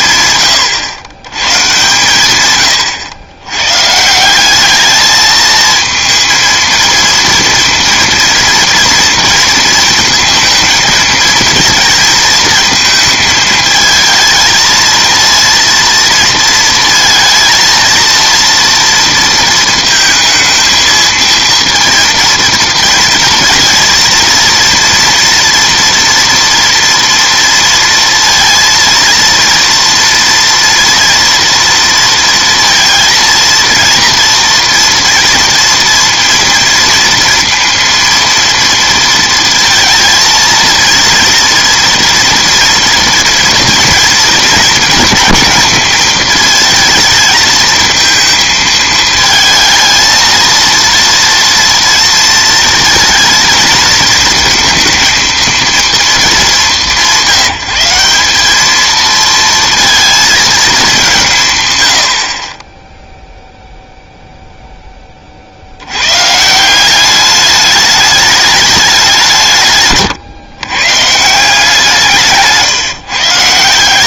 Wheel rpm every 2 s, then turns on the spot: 120, 100, 220, 230, 230, 230, 220, 230, 230, 230, 230, 220, 230, 230, 230, 230, 230, 240, 230, 230, 230, 230, 230, 230, 220, 230, 230, 230, 190, 230, 160, 0, 30, 200, 190, 150, 110.
none